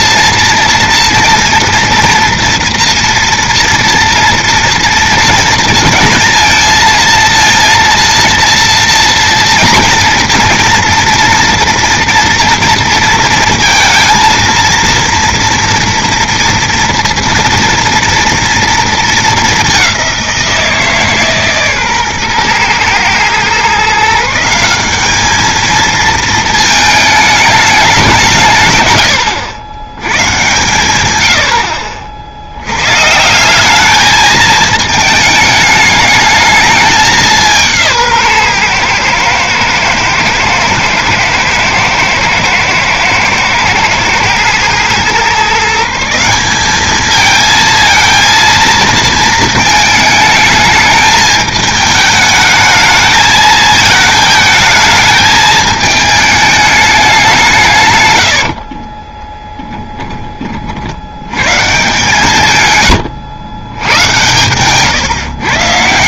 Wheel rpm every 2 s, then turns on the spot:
230, 230, 230, 220, 230, 230, 230, 230, 230, 230, 190, 130, 150, 220, 190, 110, 60, 210, 210, 160, 110, 110, 110, 170, 230, 220, 210, 220, 220, 130, 10, 140, 100.
64-66